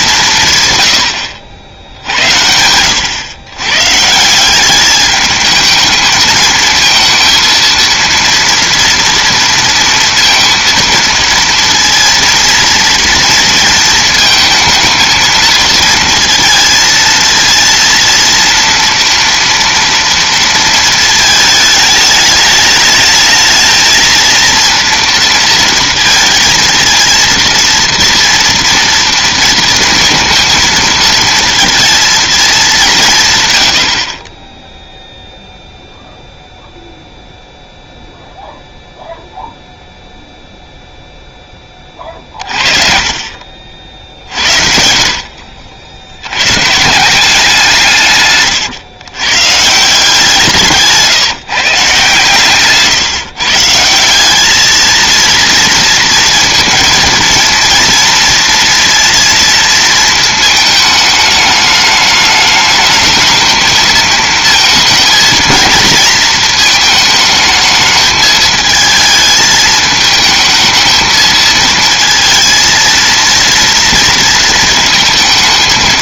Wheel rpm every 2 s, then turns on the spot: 140, 80, 190, 220, 230, 230, 230, 220, 230, 230, 230, 210, 230, 230, 230, 230, 200, 10, 0, 0, 0, 40, 60, 120, 130, 160, 140, 210, 220, 230, 220, 210, 220, 220, 220, 220, 230, 220.
48-50